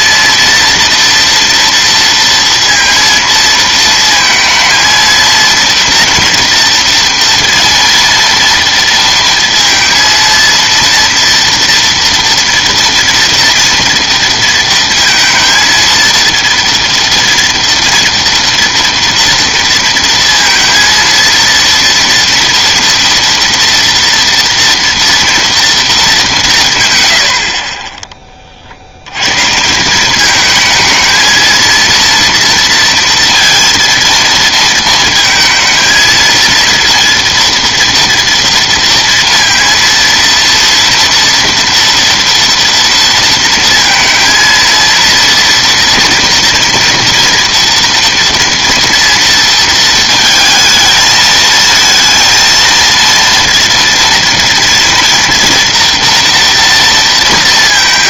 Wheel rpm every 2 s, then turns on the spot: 230, 230, 230, 230, 230, 230, 230, 230, 230, 230, 230, 230, 230, 180, 50, 220, 240, 230, 230, 230, 230, 230, 230, 240, 230, 220, 230, 230, 230.
none